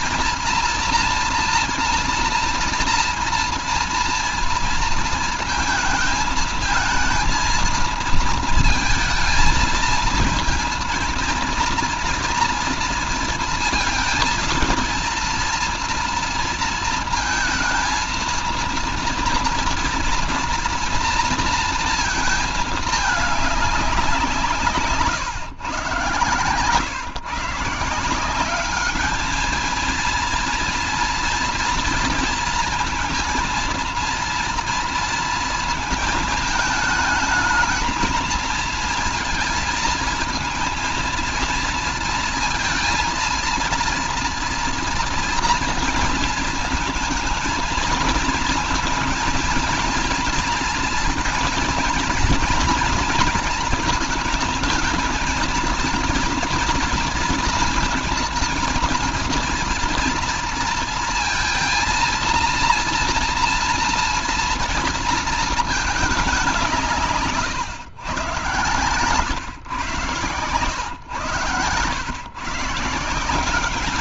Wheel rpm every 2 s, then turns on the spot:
230, 230, 230, 220, 220, 230, 230, 230, 230, 230, 230, 220, 160, 120, 200, 230, 230, 230, 220, 230, 230, 230, 230, 230, 230, 230, 230, 220, 230, 230, 230, 230, 230, 180, 120, 110, 150.
68-70